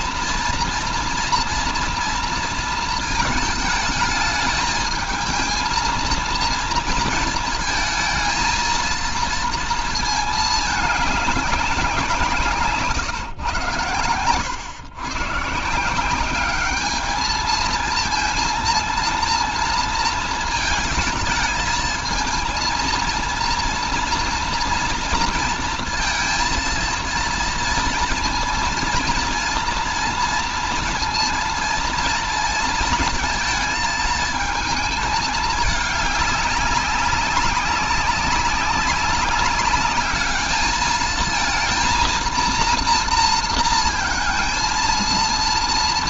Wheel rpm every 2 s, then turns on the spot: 230, 230, 210, 230, 230, 220, 150, 130, 200, 230, 220, 230, 230, 230, 230, 230, 230, 220, 200, 200, 220, 230, 230.
12-14